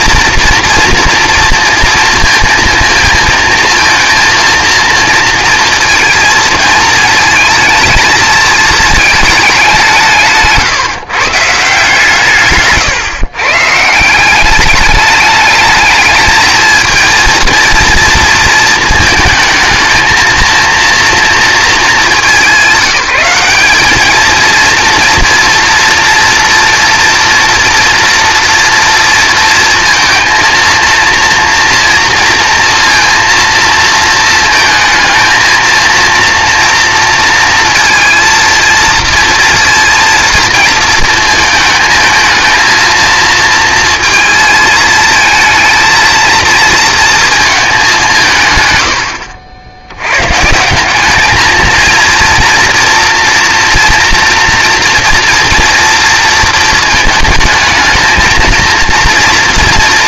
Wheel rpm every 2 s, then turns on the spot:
230, 230, 230, 220, 220, 150, 140, 200, 220, 230, 230, 200, 230, 230, 240, 230, 230, 220, 230, 230, 230, 230, 220, 230, 130, 150, 230, 230, 220, 230.
none